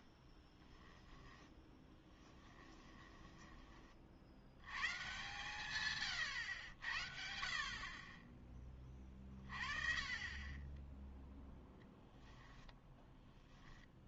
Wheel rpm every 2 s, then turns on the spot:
10, 10, 110, 90, 20, 10, 10.
0-4 12-14